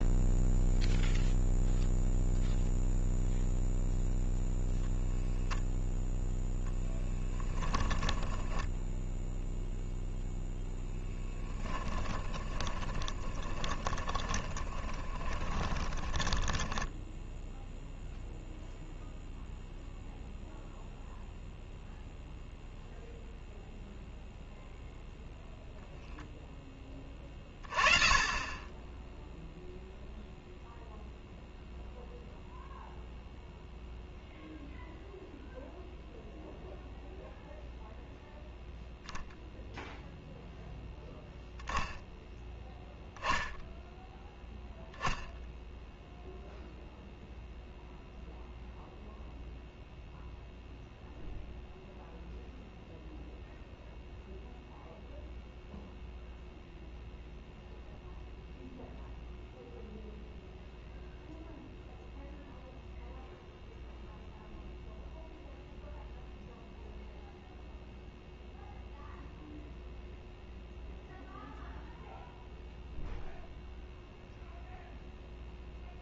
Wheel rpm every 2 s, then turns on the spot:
0, 0, 0, 0, 10, 0, 20, 20, 10, 0, 0, 0, 0, 10, 20, 0, 0, 0, 0, 0, 0, 0, 0, 0, 0, 0, 0, 0, 0, 0, 0, 0, 0, 0, 0, 0, 0, 0.
8-10 12-18